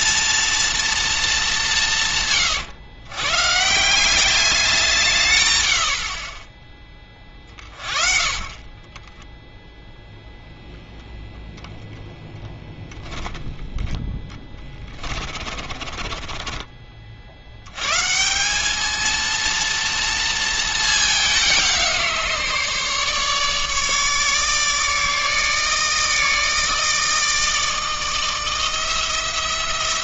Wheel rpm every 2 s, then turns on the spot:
230, 120, 190, 20, 40, 0, 10, 20, 30, 200, 220, 150, 150, 150, 160.
14-16